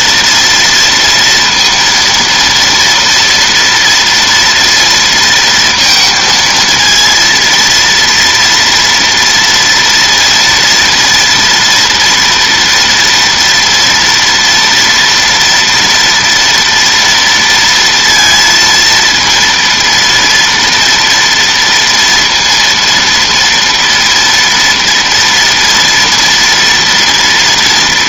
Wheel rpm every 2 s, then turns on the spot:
230, 230, 230, 230, 230, 230, 230, 230, 230, 230, 230, 230, 230, 240.
none